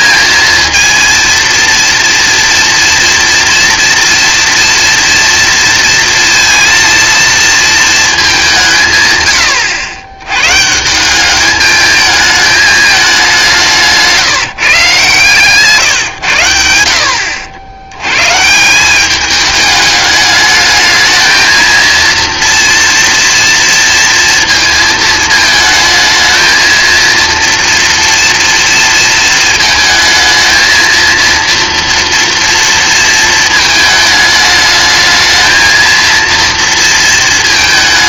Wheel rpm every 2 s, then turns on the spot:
230, 230, 230, 230, 150, 160, 210, 140, 80, 190, 220, 230, 220, 230, 230, 230, 230, 210, 230.
none